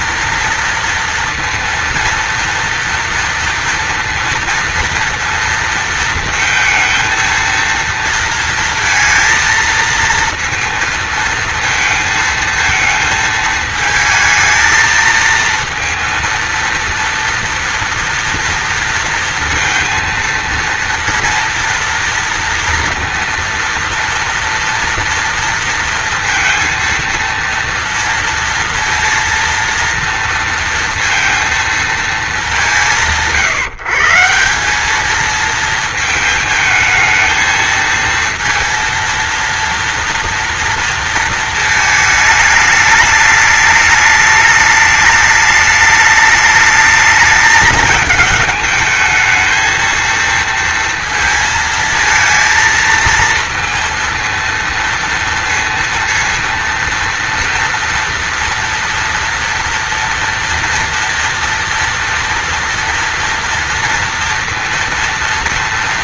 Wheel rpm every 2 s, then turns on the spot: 230, 230, 230, 220, 230, 230, 220, 220, 230, 230, 230, 230, 230, 230, 230, 230, 160, 200, 220, 230, 230, 210, 210, 210, 220, 230, 230, 230, 230, 240, 230, 230, 230.
none